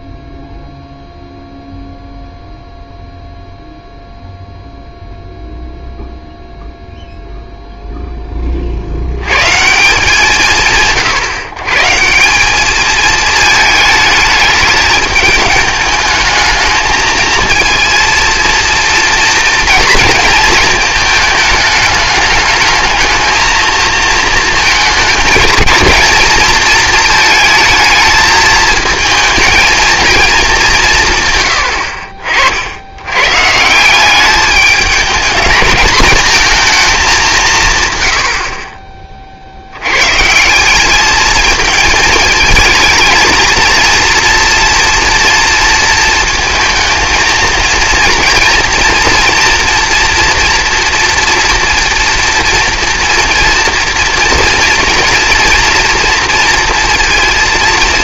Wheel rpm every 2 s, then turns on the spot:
0, 0, 0, 0, 40, 150, 210, 210, 220, 230, 220, 210, 220, 220, 220, 190, 70, 210, 220, 40, 200, 220, 230, 220, 230, 230, 230, 230, 230.
38-40